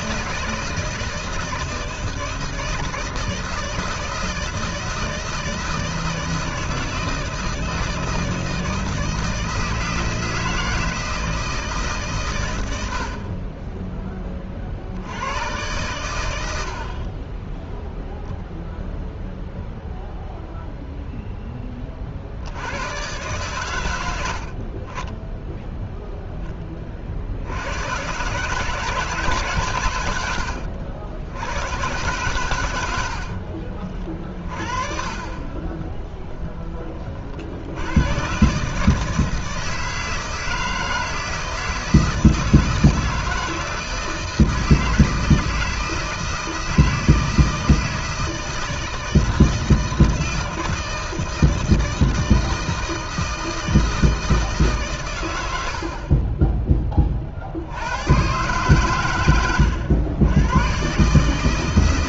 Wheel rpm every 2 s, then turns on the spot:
160, 160, 160, 160, 160, 160, 80, 60, 40, 0, 0, 110, 30, 30, 150, 80, 90, 40, 20, 150, 160, 160, 160, 160, 160, 160, 160, 130, 20, 120, 130.
none